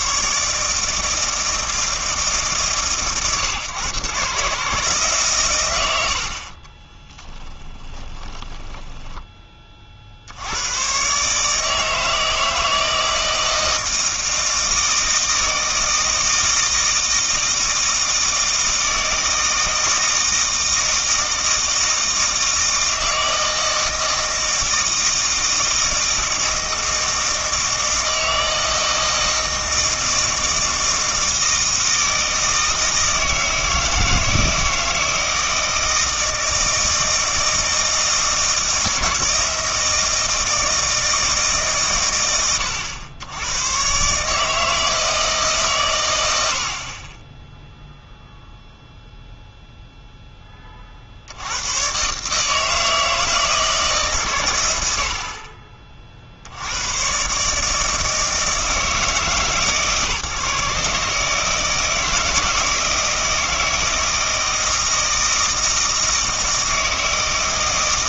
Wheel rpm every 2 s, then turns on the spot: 160, 130, 150, 20, 10, 110, 160, 160, 160, 160, 160, 160, 160, 160, 160, 160, 160, 160, 160, 160, 160, 100, 160, 50, 0, 40, 160, 80, 110, 160, 150, 160, 160, 160.
6-10